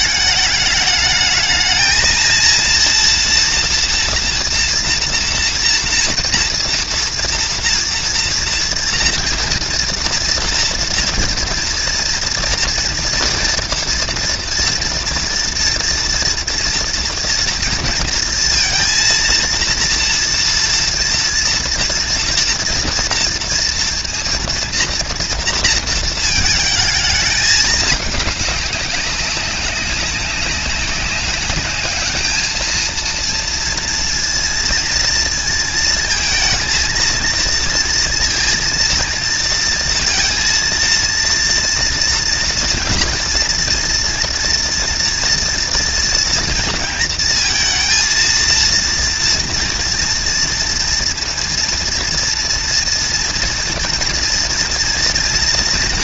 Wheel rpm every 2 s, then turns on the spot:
210, 230, 230, 230, 230, 230, 230, 230, 230, 230, 230, 230, 230, 220, 200, 190, 220, 230, 230, 230, 230, 230, 230, 230, 230, 230, 230, 230.
none